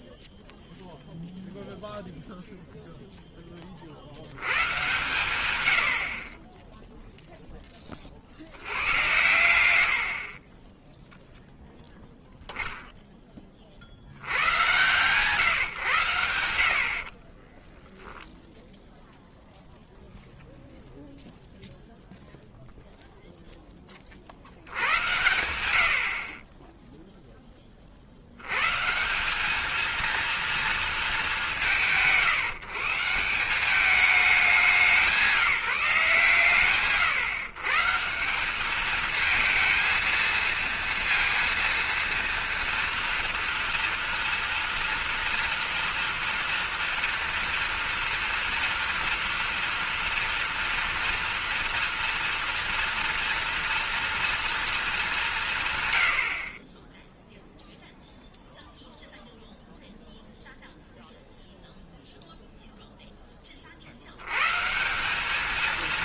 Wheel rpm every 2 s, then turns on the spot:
0, 20, 130, 10, 110, 10, 80, 110, 0, 0, 0, 10, 90, 40, 220, 160, 200, 160, 150, 230, 230, 240, 230, 230, 230, 230, 230, 160, 0, 0, 0, 10, 180.
none